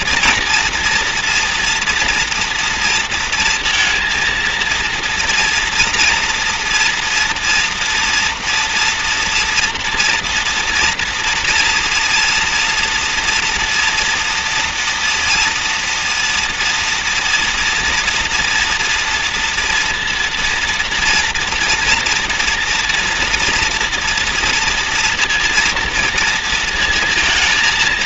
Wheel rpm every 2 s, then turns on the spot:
230, 230, 230, 240, 230, 230, 230, 230, 230, 230, 240, 230, 230, 230.
none